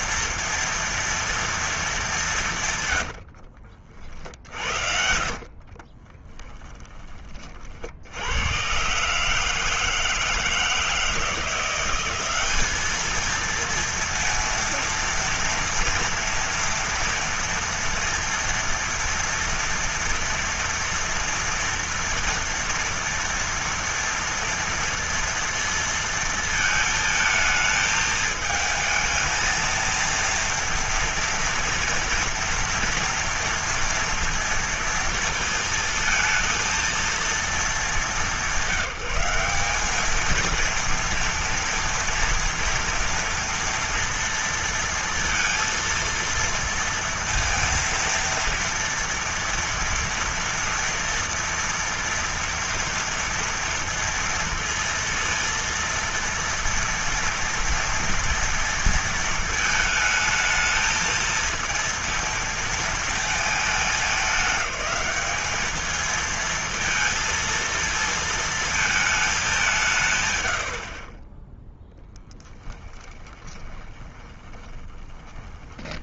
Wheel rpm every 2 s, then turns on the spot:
230, 170, 50, 30, 100, 160, 200, 230, 230, 230, 240, 230, 230, 220, 220, 230, 230, 230, 220, 190, 220, 240, 230, 230, 230, 240, 230, 230, 230, 230, 220, 230, 210, 230, 220, 90, 10, 20.
4-8 72-76